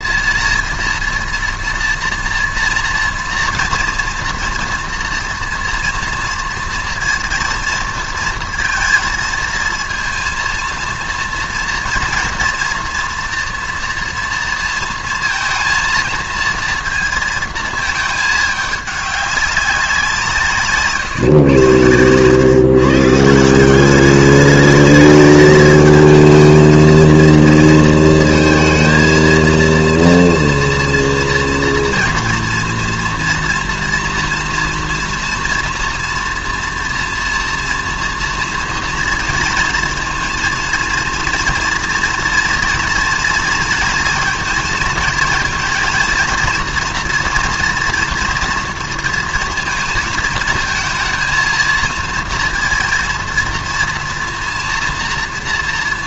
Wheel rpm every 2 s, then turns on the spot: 230, 230, 230, 240, 230, 230, 230, 230, 230, 210, 140, 140, 210, 230, 230, 230, 230, 230, 230, 230, 230, 230, 230, 230, 230, 220, 230, 230.
none